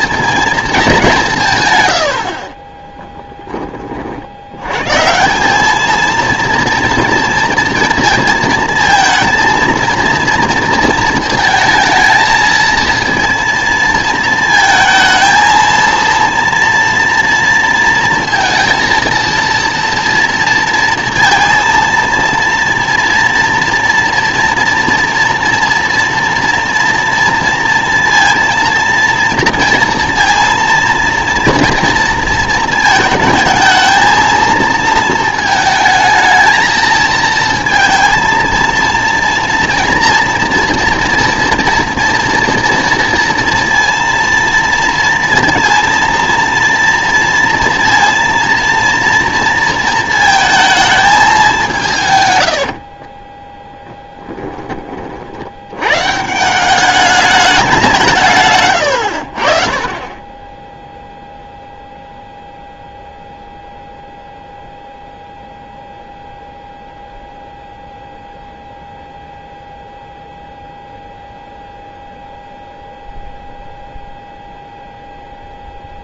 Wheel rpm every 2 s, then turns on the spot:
220, 30, 110, 230, 230, 230, 220, 220, 240, 230, 230, 230, 230, 230, 230, 230, 230, 230, 220, 230, 230, 230, 230, 230, 230, 220, 70, 20, 180, 130, 10, 0, 0, 0, 0, 0, 0, 0.
2-4 52-54